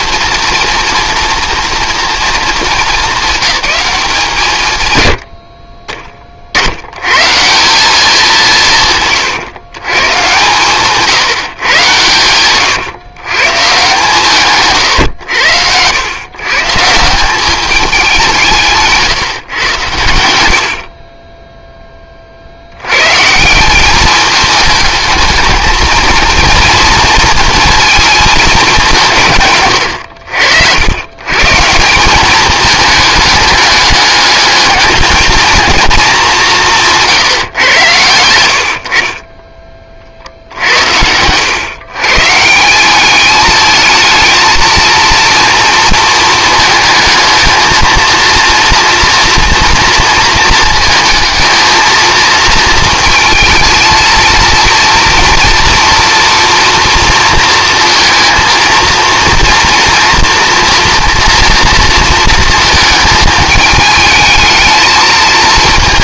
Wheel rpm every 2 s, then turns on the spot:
230, 220, 120, 90, 160, 140, 130, 130, 150, 150, 60, 90, 210, 230, 180, 90, 210, 210, 170, 60, 80, 180, 230, 220, 230, 220, 230, 230, 230, 230, 230, 220, 220.
40-42